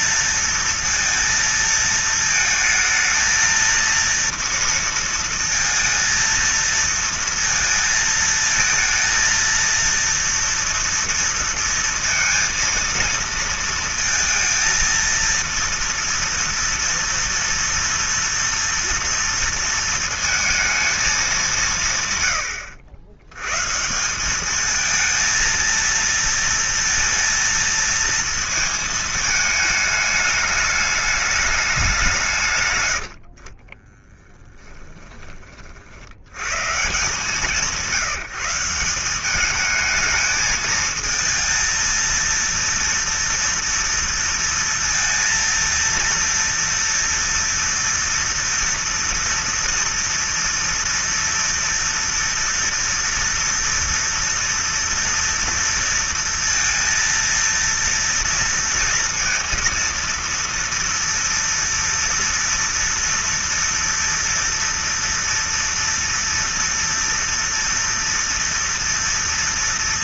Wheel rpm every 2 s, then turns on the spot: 230, 220, 230, 230, 220, 230, 230, 230, 230, 230, 220, 90, 220, 230, 220, 210, 90, 10, 150, 190, 220, 230, 230, 230, 230, 230, 240, 240, 230, 230, 230, 230, 230, 230, 230.
32-34